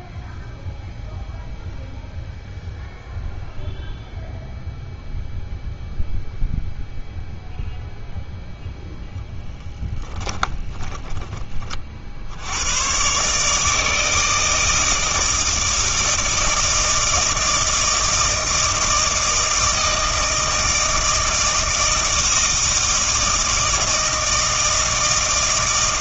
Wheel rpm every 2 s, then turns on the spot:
0, 0, 0, 0, 0, 20, 110, 160, 160, 160, 160, 160, 160.
10-12